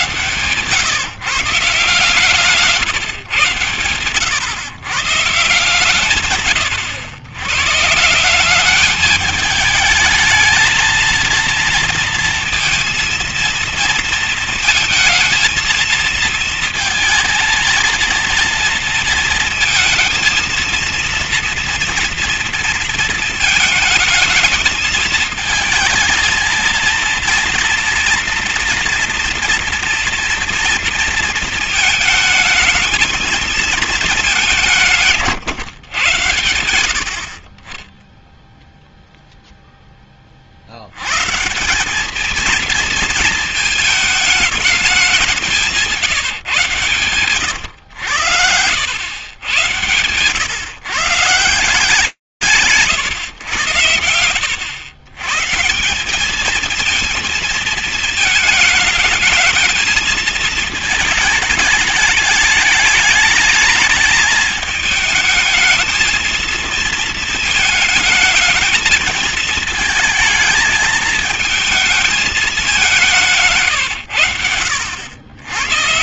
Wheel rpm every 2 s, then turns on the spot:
130, 150, 120, 130, 190, 220, 230, 230, 230, 230, 230, 230, 220, 230, 240, 240, 220, 200, 100, 0, 50, 220, 210, 130, 100, 110, 130, 100, 220, 220, 220, 210, 220, 230, 220, 220, 180, 80.
none